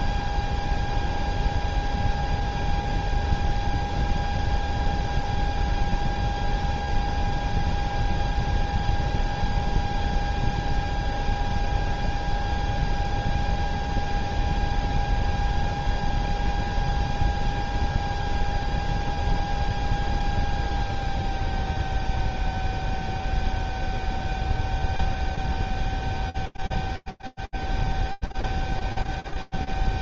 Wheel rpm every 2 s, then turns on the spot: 0, 0, 0, 0, 0, 0, 0, 0, 0, 0, 0, 0, 0, 0, 0.
none